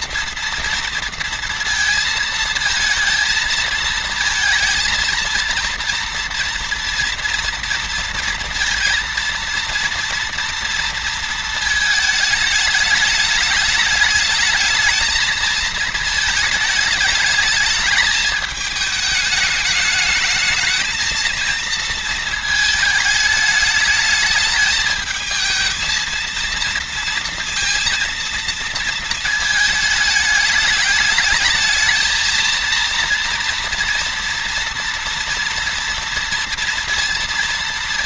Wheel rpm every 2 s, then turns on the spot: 230, 220, 230, 240, 230, 230, 210, 220, 210, 220, 220, 220, 220, 230, 220, 210, 230, 230, 230.
none